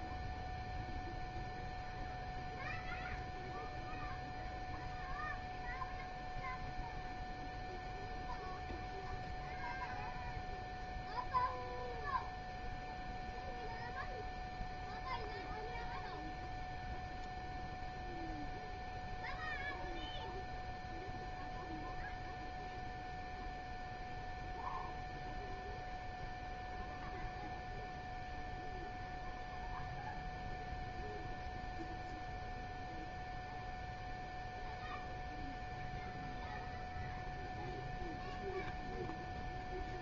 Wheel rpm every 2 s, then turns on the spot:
0, 0, 0, 0, 0, 0, 0, 0, 0, 0, 0, 0, 0, 0, 0, 0, 0, 0, 0, 0.
none